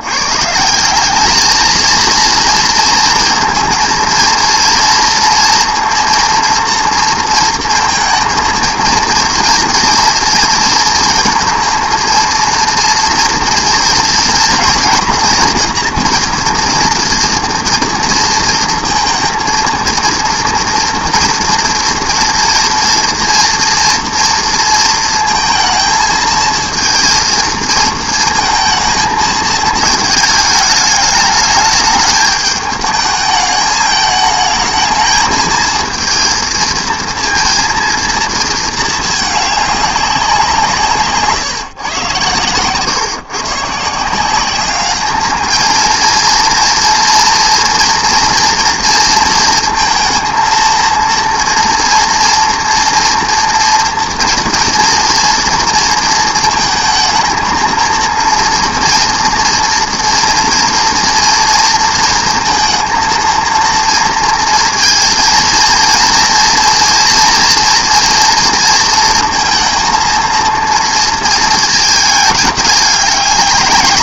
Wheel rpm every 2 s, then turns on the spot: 170, 230, 230, 230, 230, 230, 230, 240, 230, 230, 230, 230, 230, 230, 220, 210, 210, 220, 230, 220, 170, 120, 200, 230, 230, 230, 230, 230, 230, 230, 230, 230, 230, 240, 230, 230, 210.
none